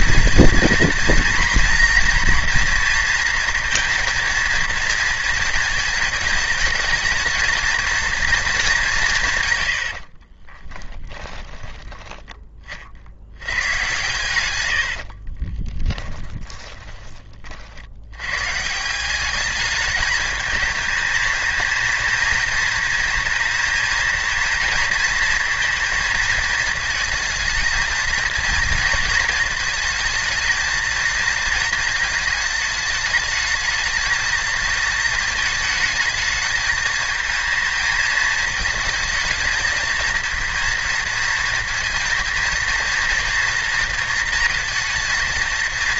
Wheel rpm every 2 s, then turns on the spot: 230, 230, 230, 220, 200, 20, 40, 70, 20, 160, 210, 230, 220, 220, 230, 230, 220, 220, 220, 220, 230, 230, 230.
10-12 14-18